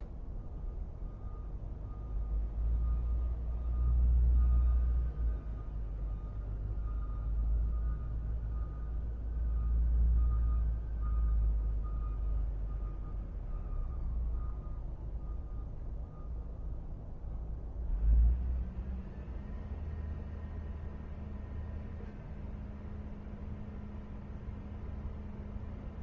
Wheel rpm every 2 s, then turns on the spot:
0, 0, 0, 0, 0, 0, 0, 0, 0, 0, 0, 0, 0.
none